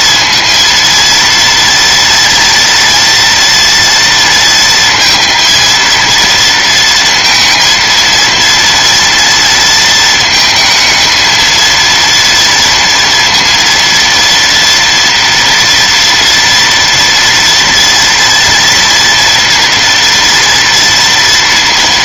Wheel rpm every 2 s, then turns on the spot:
230, 230, 230, 230, 230, 220, 230, 230, 230, 230, 230.
none